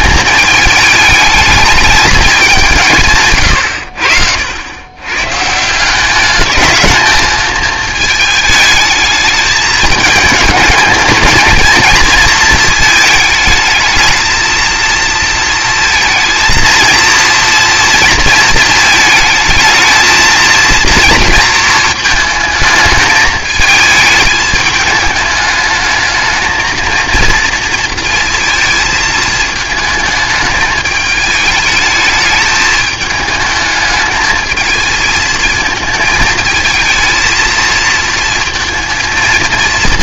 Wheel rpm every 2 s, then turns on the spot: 210, 190, 90, 220, 220, 220, 220, 230, 230, 230, 230, 220, 210, 220, 230, 220, 210, 220, 220, 230.
none